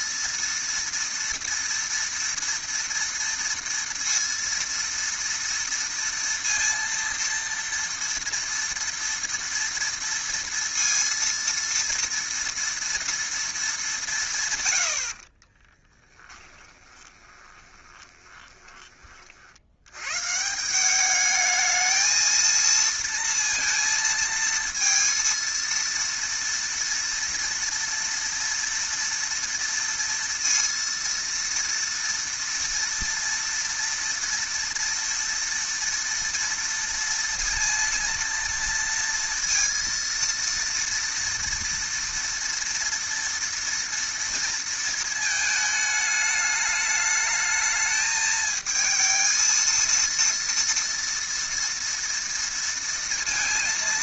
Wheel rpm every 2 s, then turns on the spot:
230, 230, 230, 230, 230, 230, 230, 140, 10, 20, 150, 230, 230, 230, 240, 230, 230, 230, 230, 230, 230, 240, 230, 210, 220, 230, 230.
16-20